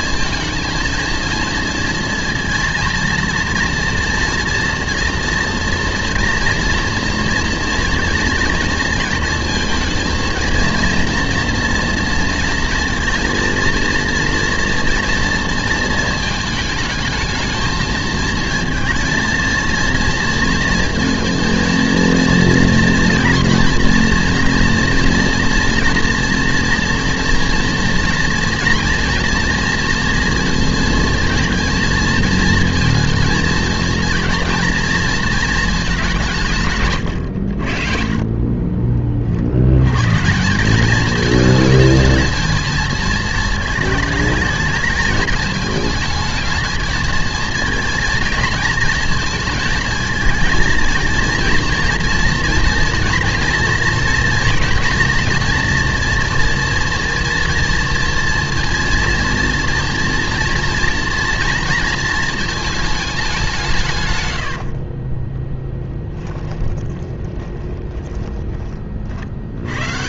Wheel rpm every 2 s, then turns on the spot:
230, 230, 230, 230, 230, 230, 230, 230, 220, 230, 230, 230, 240, 230, 230, 230, 230, 230, 130, 30, 190, 220, 220, 220, 230, 220, 230, 240, 240, 230, 230, 220, 60, 20, 40.
64-68